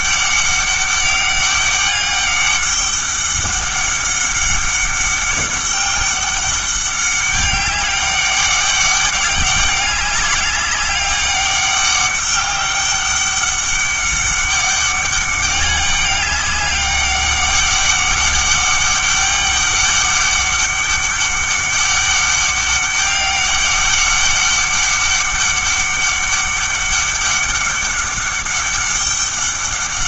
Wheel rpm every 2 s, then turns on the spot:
200, 200, 200, 200, 200, 200, 200, 200, 200, 200, 200, 200, 200, 200, 200.
none